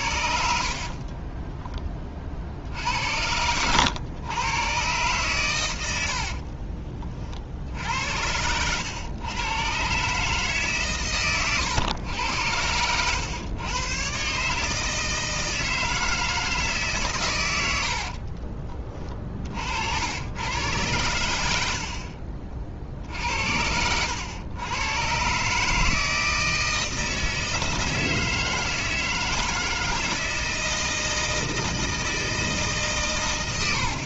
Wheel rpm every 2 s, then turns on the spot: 40, 70, 120, 50, 100, 130, 100, 150, 150, 30, 110, 50, 110, 160, 160, 160, 140.
0-2 6-8 18-20